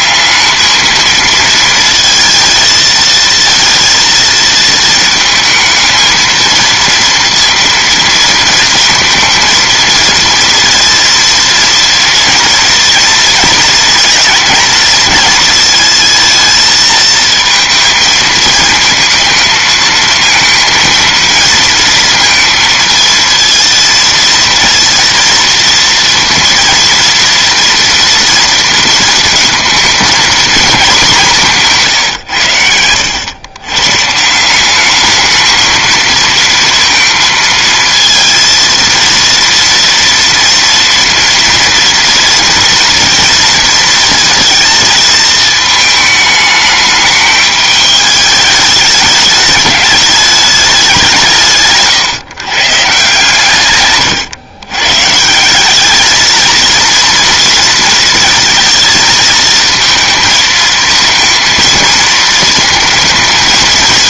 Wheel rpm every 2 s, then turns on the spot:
220, 230, 230, 230, 220, 230, 230, 240, 220, 220, 230, 230, 230, 230, 230, 220, 90, 190, 230, 230, 230, 230, 230, 210, 210, 200, 140, 120, 230, 230, 220, 220.
none